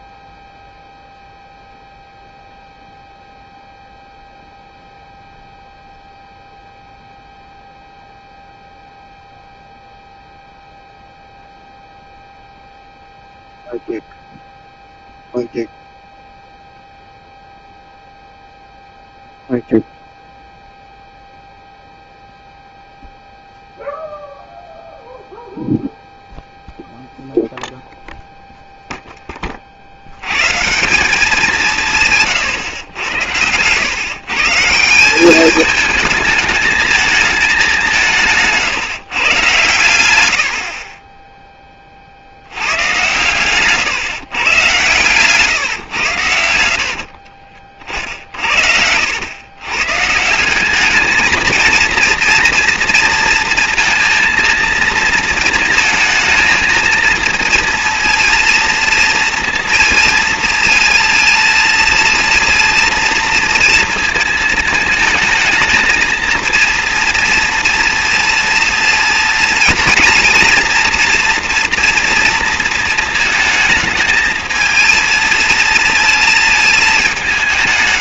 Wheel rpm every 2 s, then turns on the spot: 0, 0, 0, 0, 0, 0, 0, 0, 0, 0, 0, 0, 0, 0, 0, 150, 130, 160, 220, 160, 70, 100, 130, 70, 60, 190, 230, 230, 230, 230, 220, 230, 220, 230, 230, 230, 230, 230, 220.
46-50